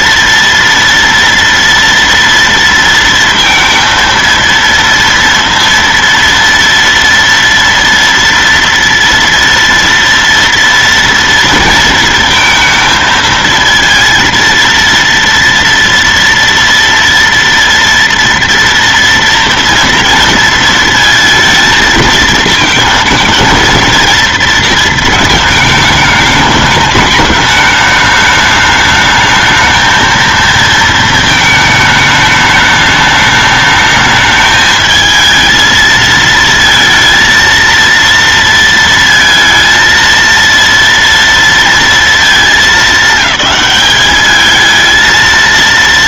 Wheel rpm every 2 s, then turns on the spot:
230, 230, 230, 230, 230, 240, 230, 230, 230, 230, 230, 220, 230, 210, 210, 230, 210, 210, 220, 230, 230, 220, 210.
none